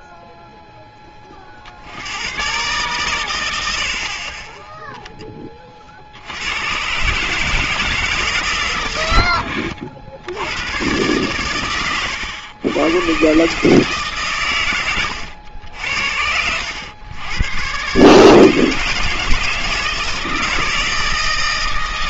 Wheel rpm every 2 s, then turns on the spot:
0, 110, 20, 110, 120, 110, 110, 110, 90, 160, 160.
none